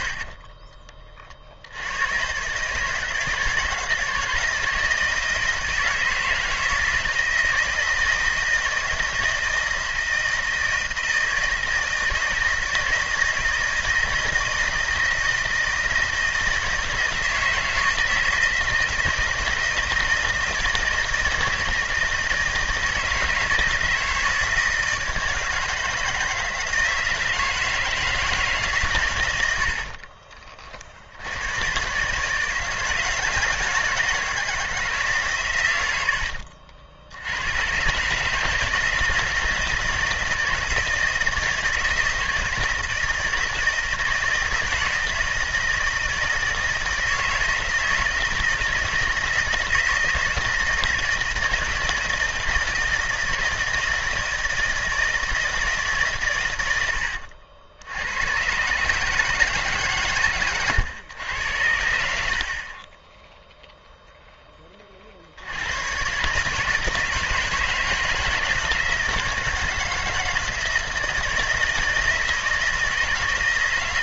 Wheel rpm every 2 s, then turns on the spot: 30, 140, 160, 160, 160, 160, 160, 160, 160, 160, 160, 160, 160, 160, 150, 50, 160, 160, 60, 160, 160, 160, 160, 160, 160, 160, 160, 160, 110, 130, 120, 40, 20, 150, 160, 160, 160.
0-2 56-58 62-64